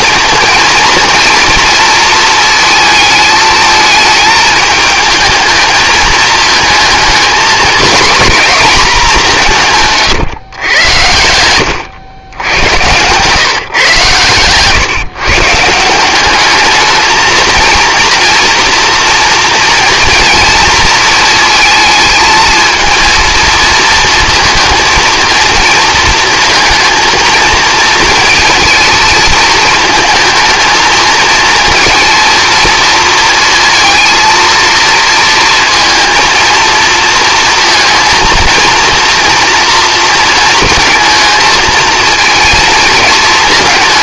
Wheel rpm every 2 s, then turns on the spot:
230, 220, 220, 220, 230, 110, 110, 120, 210, 230, 230, 230, 230, 230, 220, 220, 230, 230, 230, 230, 220, 230.
none